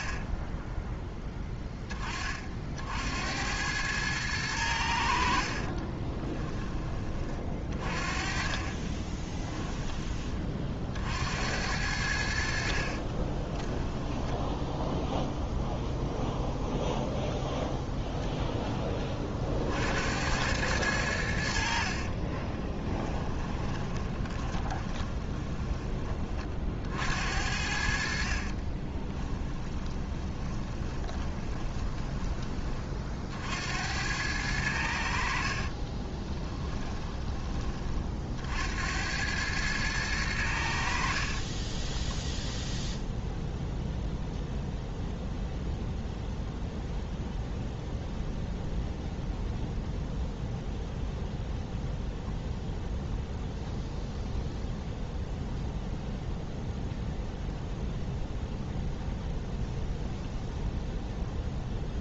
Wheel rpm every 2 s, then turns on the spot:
10, 50, 90, 20, 40, 40, 60, 0, 0, 10, 100, 20, 20, 50, 40, 10, 20, 90, 10, 70, 80, 0, 0, 0, 0, 0, 0, 0, 0, 0, 0.
6-10 22-26 28-32 36-38